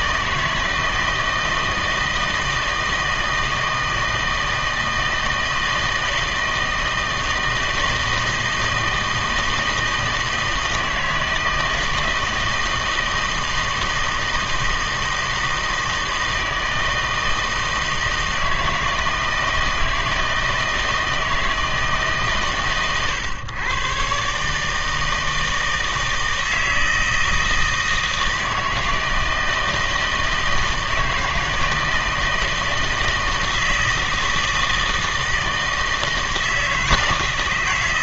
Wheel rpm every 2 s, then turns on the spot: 160, 160, 160, 160, 160, 160, 160, 160, 160, 160, 160, 130, 150, 160, 160, 160, 160, 160, 160.
none